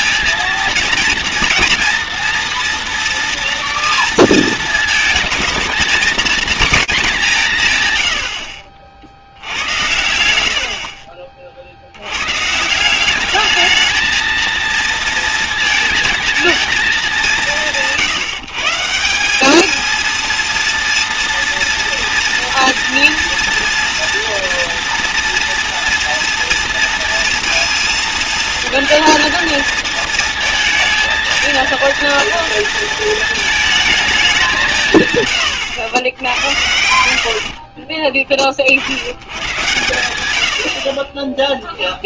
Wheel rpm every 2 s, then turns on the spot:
230, 230, 220, 220, 60, 70, 160, 230, 220, 160, 230, 240, 230, 230, 230, 220, 230, 170, 90, 70, 60.
10-12